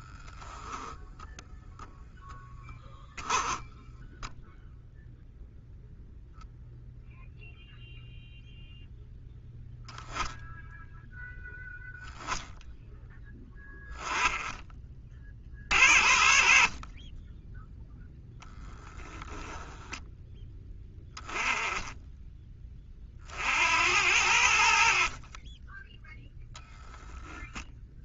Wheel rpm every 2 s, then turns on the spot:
0, 10, 0, 0, 0, 10, 10, 50, 10, 10, 10, 50, 40, 10.
none